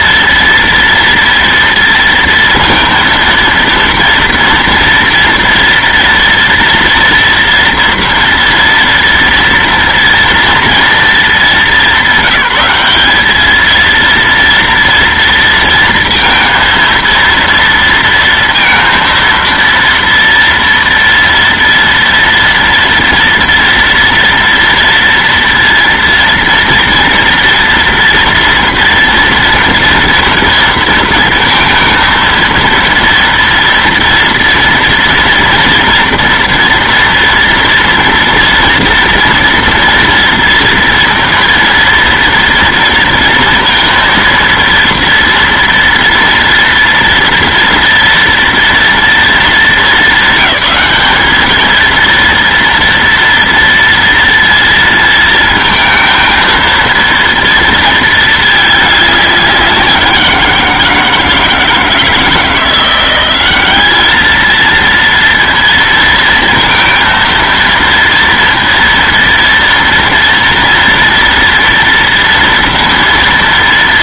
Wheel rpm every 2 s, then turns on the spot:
230, 230, 230, 230, 230, 230, 200, 230, 230, 230, 230, 230, 230, 230, 240, 230, 230, 230, 230, 230, 230, 230, 230, 230, 230, 200, 230, 230, 230, 200, 170, 170, 230, 230, 230, 230, 230.
none